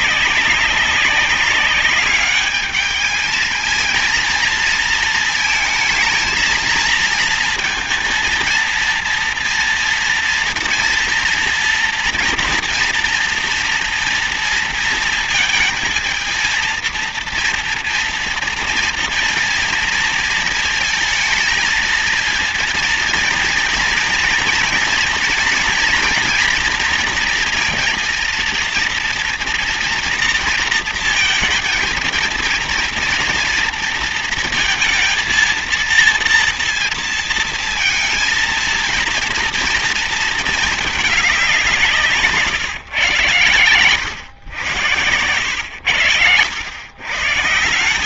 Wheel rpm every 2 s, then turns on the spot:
190, 210, 230, 230, 230, 230, 230, 230, 230, 230, 220, 230, 230, 230, 230, 230, 230, 230, 230, 230, 220, 140, 100, 120.
none